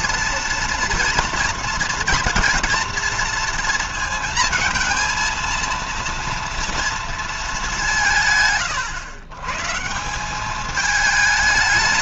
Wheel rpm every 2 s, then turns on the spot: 230, 230, 230, 230, 130, 210.
none